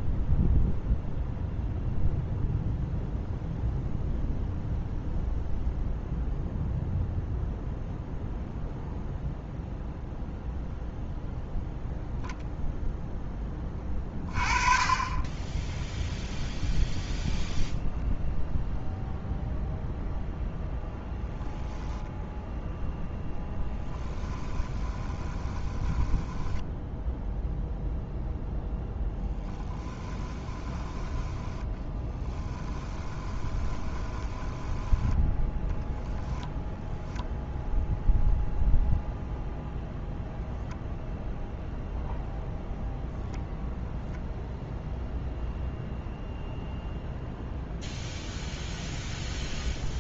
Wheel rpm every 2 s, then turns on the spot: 0, 0, 0, 0, 0, 0, 0, 30, 0, 0, 0, 0, 20, 0, 0, 10, 20, 10, 0, 0, 0, 0, 0, 0, 0.
24-26 30-36